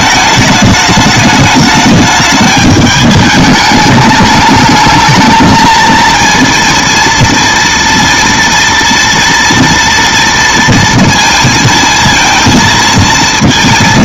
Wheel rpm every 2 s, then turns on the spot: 210, 210, 220, 230, 230, 230, 230.
none